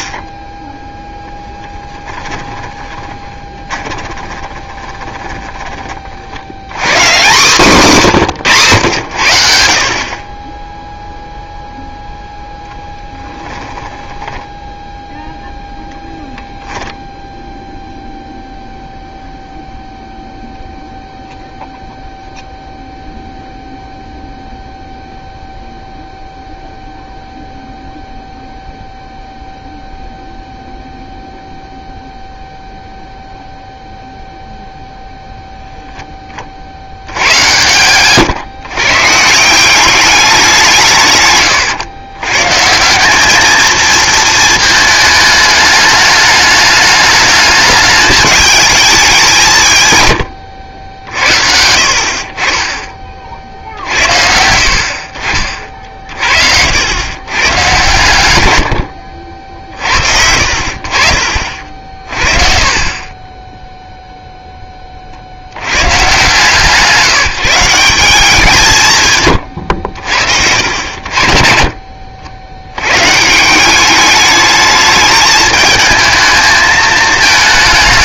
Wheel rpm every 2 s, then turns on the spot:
10, 20, 20, 110, 130, 10, 0, 10, 0, 0, 0, 0, 0, 0, 0, 0, 0, 0, 50, 130, 180, 150, 220, 210, 210, 100, 30, 60, 70, 110, 60, 40, 10, 150, 180, 70, 90, 210, 220.
2-6 62-64